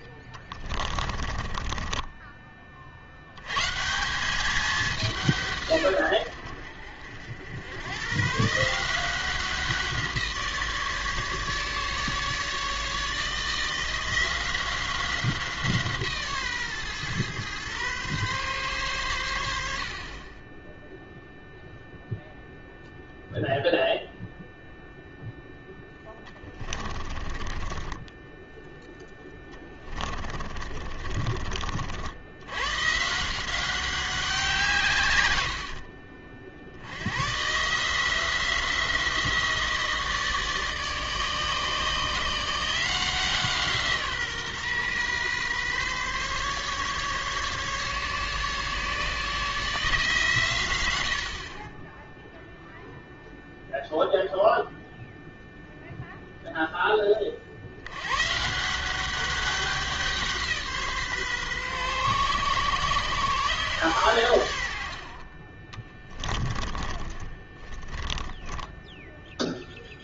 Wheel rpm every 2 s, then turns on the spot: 20, 30, 200, 80, 150, 160, 150, 180, 140, 130, 10, 0, 0, 20, 10, 50, 100, 170, 60, 170, 150, 170, 140, 140, 140, 140, 0, 0, 0, 160, 170, 130, 90, 20, 10.
0-2 26-32 66-70